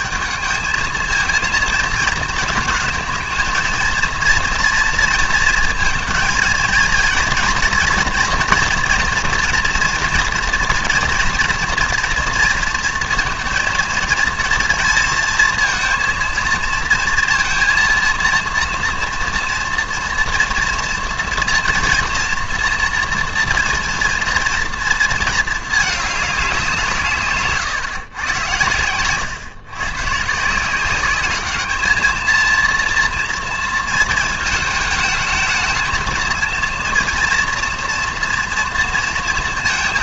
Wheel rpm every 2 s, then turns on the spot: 210, 220, 230, 230, 230, 230, 230, 230, 230, 230, 230, 230, 230, 180, 120, 170, 230, 210, 230, 230.
none